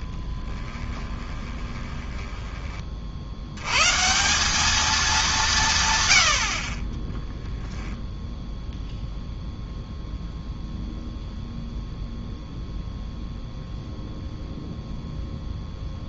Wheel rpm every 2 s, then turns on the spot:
20, 30, 200, 50, 0, 0, 0, 0.
0-2